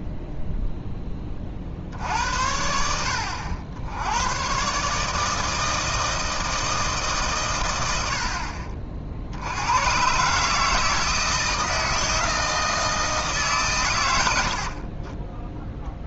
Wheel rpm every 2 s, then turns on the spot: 0, 70, 130, 160, 50, 150, 160, 70.
none